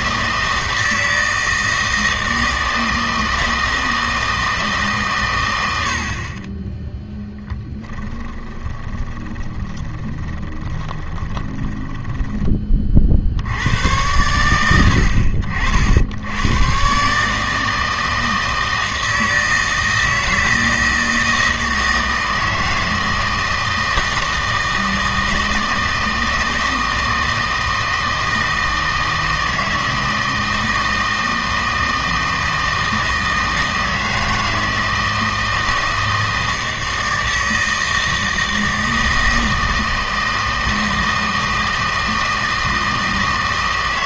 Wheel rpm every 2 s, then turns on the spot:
160, 160, 150, 10, 20, 20, 30, 80, 130, 160, 160, 160, 160, 160, 160, 160, 160, 160, 160, 160, 160, 160.
8-12